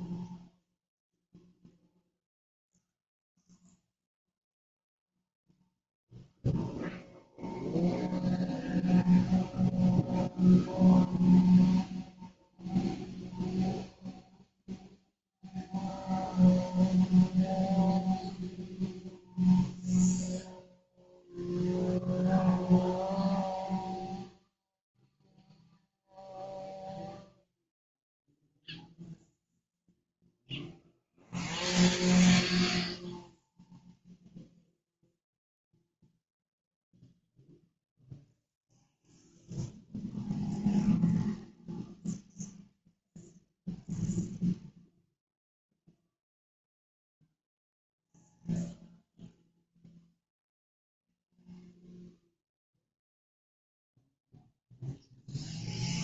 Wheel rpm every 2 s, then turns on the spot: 0, 0, 0, 0, 0, 0, 0, 0, 0, 0, 0, 0, 0, 0, 0, 0, 0, 0, 0, 0, 0, 0, 0, 0, 0, 0, 0, 0.
none